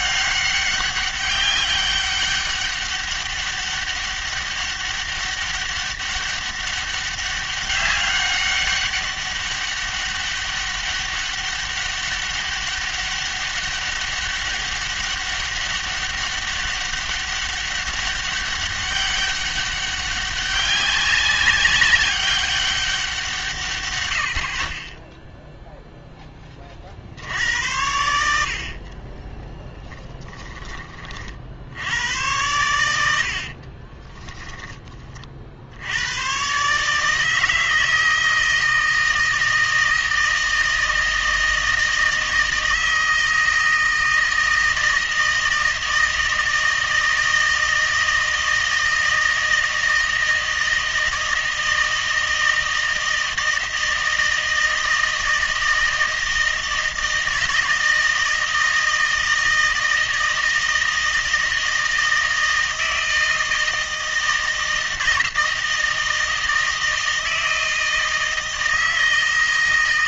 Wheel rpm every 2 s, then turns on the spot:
200, 200, 200, 200, 200, 200, 200, 200, 200, 200, 200, 190, 30, 20, 60, 20, 100, 20, 140, 160, 160, 160, 160, 160, 160, 160, 160, 160, 160, 160, 160, 160, 160, 160, 160.
none